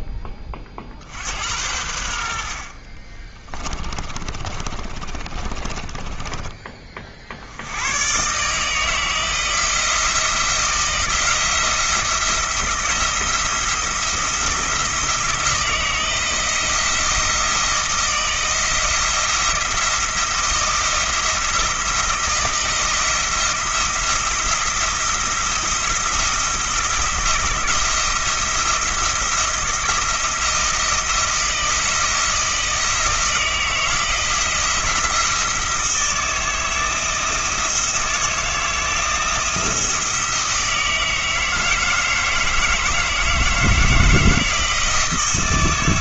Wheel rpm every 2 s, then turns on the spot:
50, 40, 30, 30, 160, 170, 170, 170, 160, 170, 160, 160, 170, 170, 170, 170, 170, 170, 160, 160, 160, 160, 170.
2-6